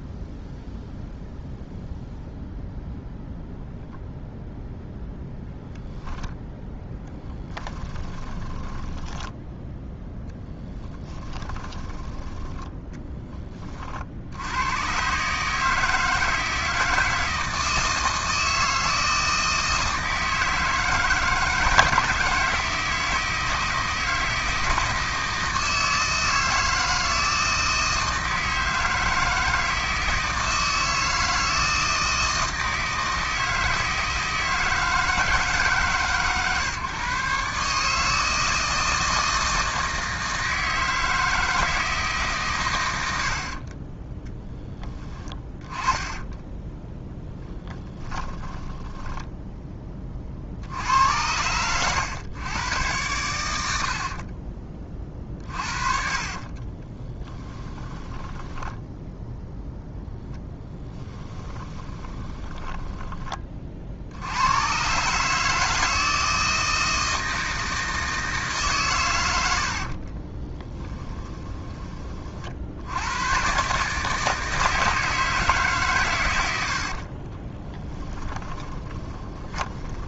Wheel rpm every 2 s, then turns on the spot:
0, 0, 0, 0, 10, 10, 10, 130, 160, 160, 160, 160, 160, 160, 160, 160, 160, 160, 140, 160, 160, 100, 20, 10, 10, 80, 110, 30, 20, 10, 20, 10, 130, 160, 120, 10, 80, 160, 60, 20.
8-12 44-46 48-50 54-64 70-72 76-80